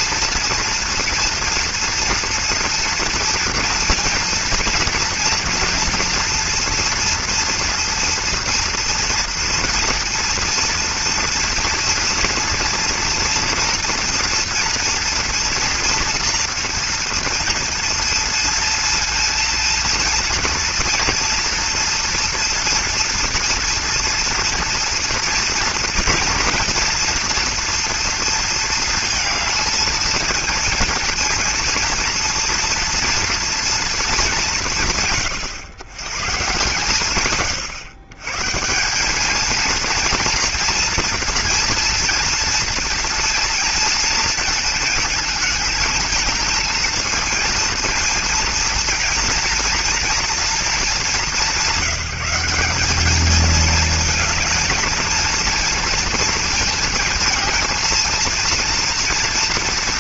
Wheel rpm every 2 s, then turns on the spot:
230, 240, 230, 230, 230, 230, 230, 230, 230, 230, 230, 230, 230, 230, 220, 230, 230, 170, 140, 160, 230, 230, 230, 220, 230, 210, 190, 220, 220, 230.
none